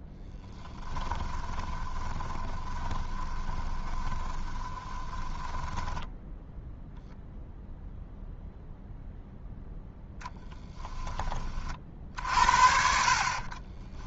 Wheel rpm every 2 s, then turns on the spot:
20, 20, 20, 0, 0, 10, 50.
0-6